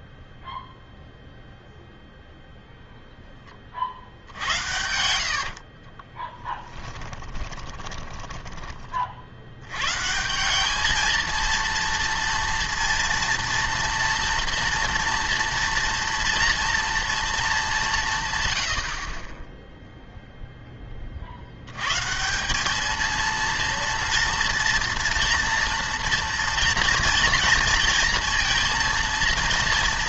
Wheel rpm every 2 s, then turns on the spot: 0, 0, 80, 10, 20, 200, 230, 230, 240, 90, 10, 200, 230, 240, 230.
6-8